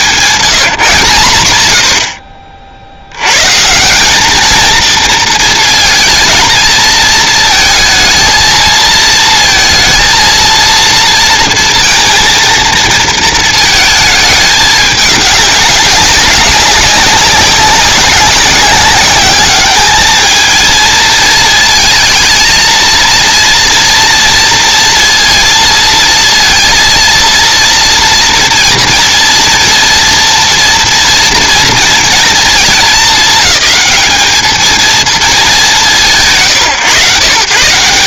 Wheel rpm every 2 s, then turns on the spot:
160, 60, 220, 230, 220, 230, 230, 210, 200, 190, 220, 220, 230, 230, 230, 230, 220, 220, 140.
none